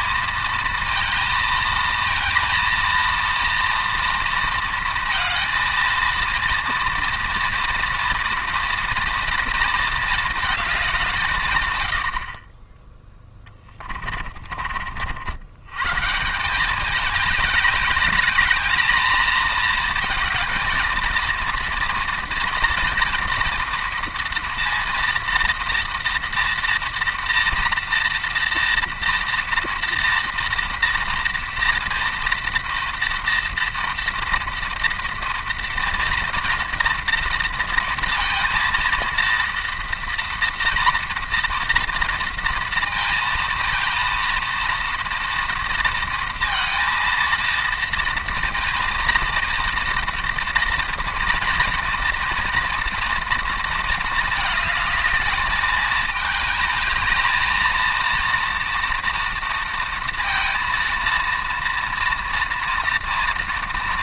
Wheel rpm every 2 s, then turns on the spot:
230, 230, 230, 230, 230, 210, 20, 50, 200, 220, 230, 240, 230, 230, 240, 230, 230, 230, 230, 230, 230, 230, 230, 230, 220, 230, 230, 220, 220, 230, 230, 230.
none